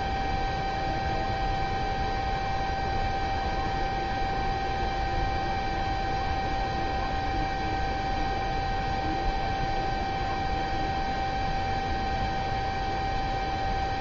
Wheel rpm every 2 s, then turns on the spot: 0, 0, 0, 0, 0, 0, 0.
none